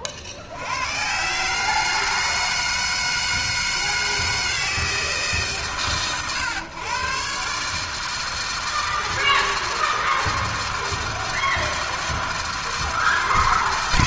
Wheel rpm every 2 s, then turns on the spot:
100, 160, 160, 120, 160, 160, 160.
none